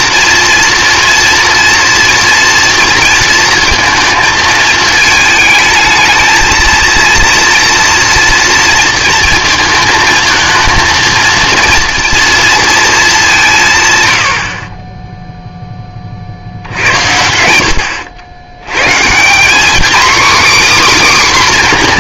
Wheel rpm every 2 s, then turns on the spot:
230, 230, 220, 220, 230, 230, 220, 30, 80, 130, 280.
none